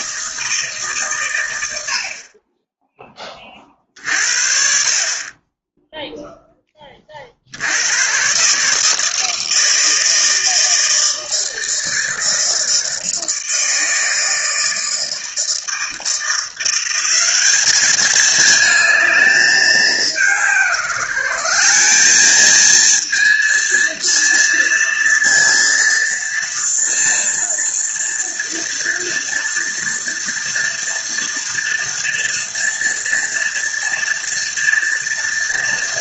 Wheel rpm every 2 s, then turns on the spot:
140, 20, 40, 30, 150, 160, 160, 160, 180, 220, 170, 230, 230, 230, 230, 240, 230, 230.
none